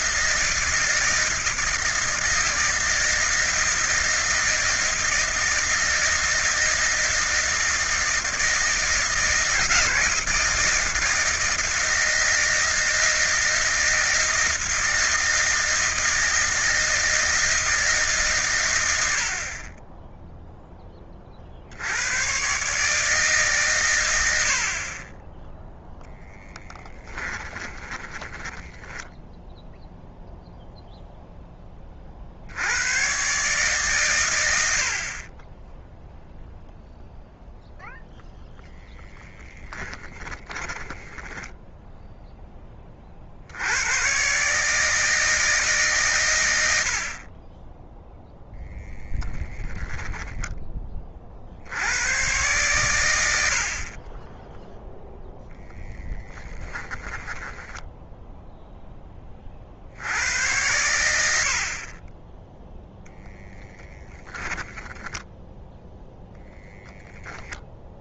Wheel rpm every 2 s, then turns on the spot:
160, 160, 160, 160, 160, 160, 160, 160, 160, 130, 10, 130, 50, 10, 10, 0, 90, 80, 0, 0, 10, 20, 150, 90, 0, 20, 120, 10, 10, 10, 100, 0, 10, 10.
26-30 40-42 56-58